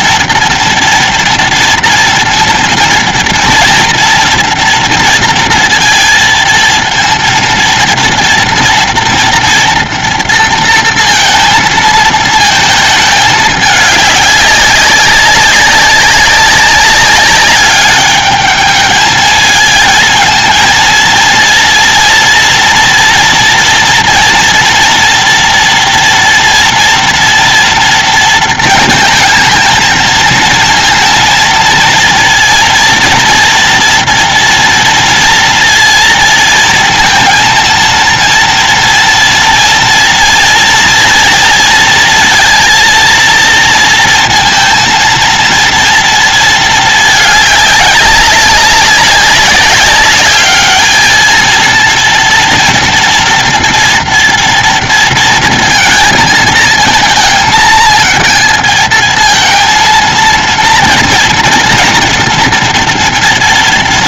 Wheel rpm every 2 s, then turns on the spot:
240, 230, 230, 230, 230, 230, 220, 200, 200, 220, 230, 230, 230, 230, 220, 230, 230, 230, 230, 230, 230, 230, 230, 210, 200, 220, 230, 230, 220, 220, 230, 230.
none